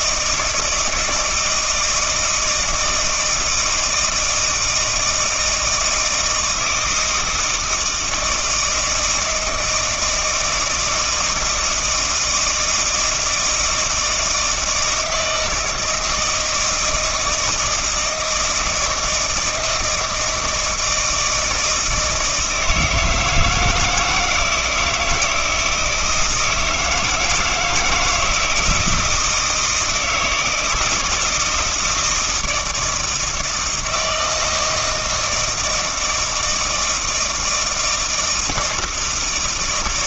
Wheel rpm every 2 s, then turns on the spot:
160, 160, 160, 160, 160, 160, 160, 160, 160, 160, 160, 160, 160, 160, 170, 160, 160, 160, 160, 160.
none